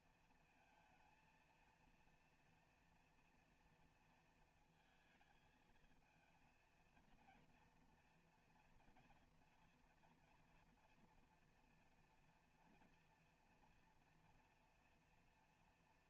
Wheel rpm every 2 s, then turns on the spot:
230, 230, 230, 220, 230, 240, 230, 240.
none